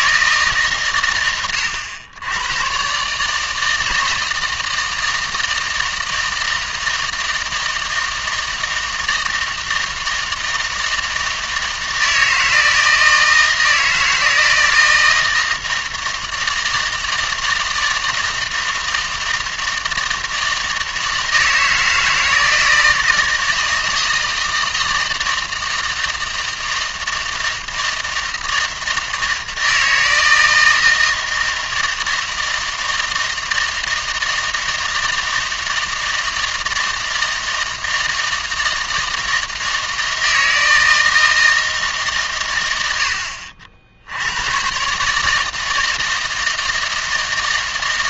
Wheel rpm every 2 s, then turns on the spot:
130, 130, 160, 160, 160, 160, 160, 170, 160, 160, 160, 160, 160, 160, 160, 160, 160, 160, 160, 160, 160, 90, 130, 160.
none